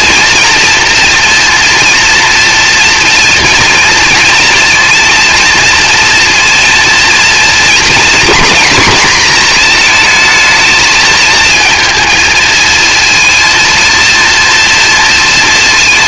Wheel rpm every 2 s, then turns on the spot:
230, 230, 230, 230, 230, 220, 220, 230.
none